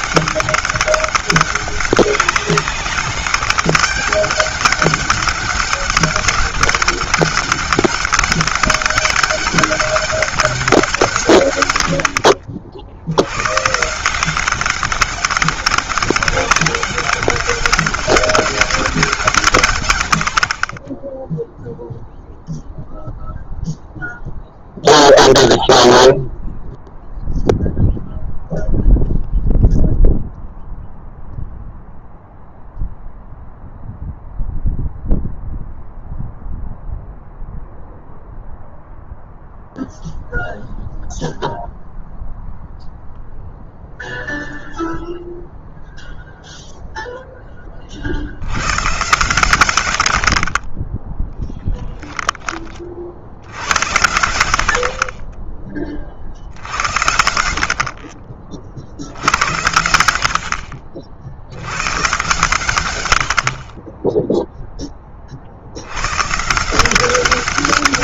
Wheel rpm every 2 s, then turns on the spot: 200, 200, 200, 200, 200, 160, 80, 200, 200, 180, 20, 0, 0, 0, 0, 0, 0, 0, 0, 0, 0, 0, 0, 10, 130, 20, 50, 50, 70, 70, 70, 100, 20, 180.
none